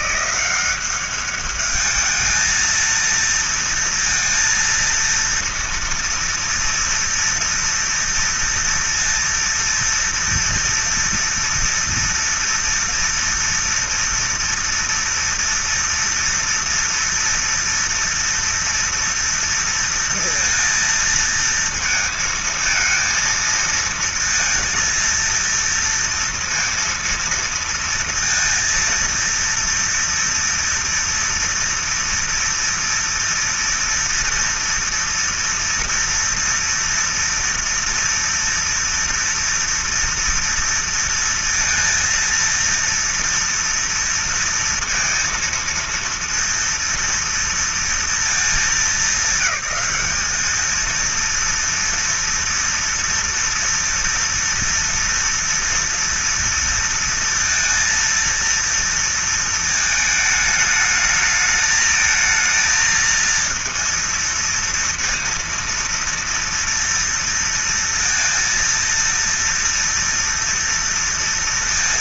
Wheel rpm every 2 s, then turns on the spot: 180, 220, 230, 230, 230, 230, 240, 230, 230, 230, 230, 220, 230, 230, 230, 230, 230, 230, 230, 230, 230, 230, 230, 230, 230, 210, 230, 230, 230, 230, 220, 220, 230, 230, 230, 230.
none